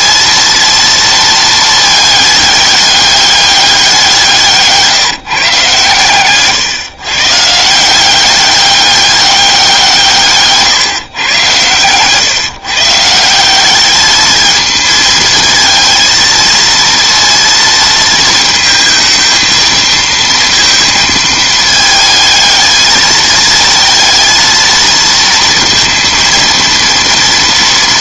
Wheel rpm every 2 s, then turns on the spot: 230, 210, 160, 130, 200, 150, 140, 220, 220, 220, 230, 220, 230, 230.
4-6